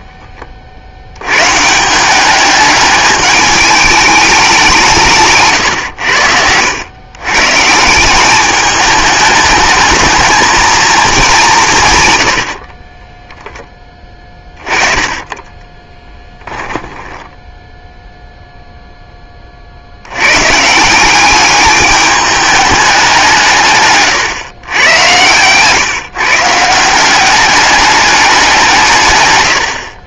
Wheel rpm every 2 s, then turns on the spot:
50, 210, 190, 100, 210, 220, 40, 20, 10, 0, 160, 200, 110, 160, 170.
12-18